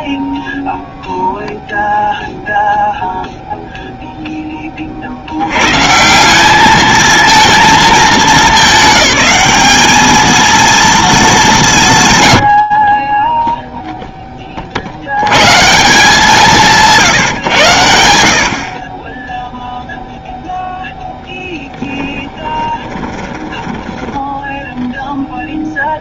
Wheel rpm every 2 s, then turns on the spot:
0, 0, 140, 210, 210, 170, 20, 180, 90, 0, 30, 10, 0.
20-24